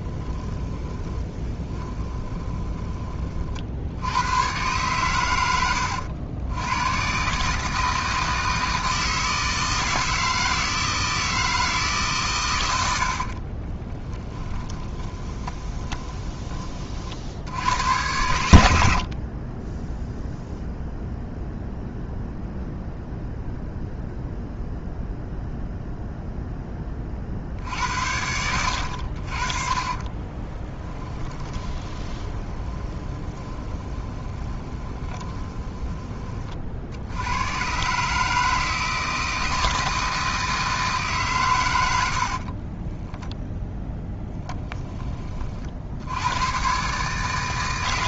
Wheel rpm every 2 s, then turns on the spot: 20, 20, 120, 110, 160, 160, 80, 20, 40, 80, 0, 0, 0, 20, 80, 20, 20, 20, 60, 160, 150, 20, 10, 130.
0-2 12-16 30-36 42-44